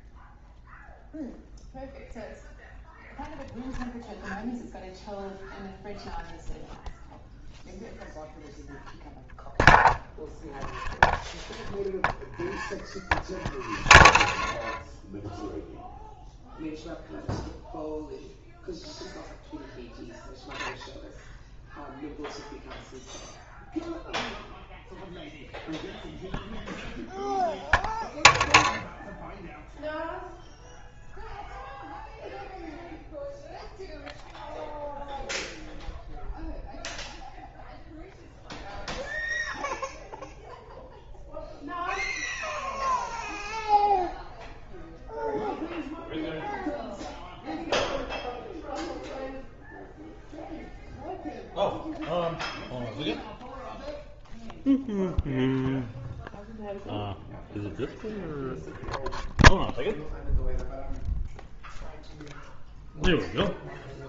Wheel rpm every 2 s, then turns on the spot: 0, 0, 0, 0, 0, 0, 0, 0, 0, 0, 0, 0, 0, 0, 0, 0, 0, 0, 0, 0, 0, 0, 0, 0, 0, 0, 0, 0, 0, 0, 0, 0.
none